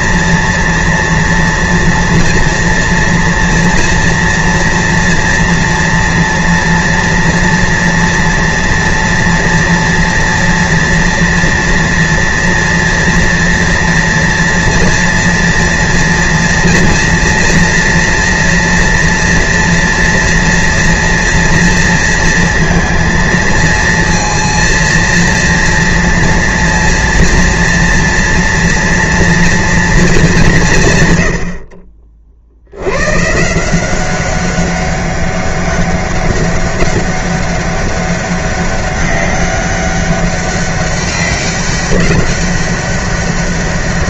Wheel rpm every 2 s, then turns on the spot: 230, 230, 230, 230, 230, 230, 230, 230, 230, 230, 230, 230, 230, 230, 240, 170, 80, 200, 200, 200, 200, 200.
none